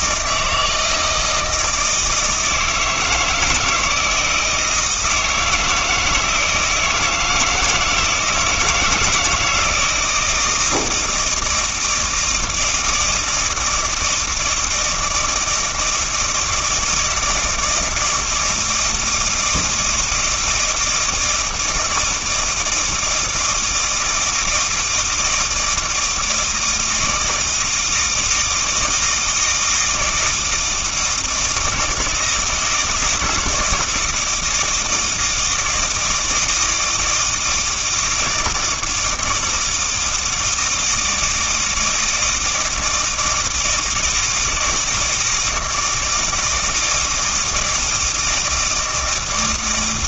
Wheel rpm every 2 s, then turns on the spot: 160, 160, 160, 160, 170, 160, 160, 160, 160, 160, 160, 160, 160, 160, 160, 160, 160, 170, 160, 160, 160, 160, 160, 160, 160.
none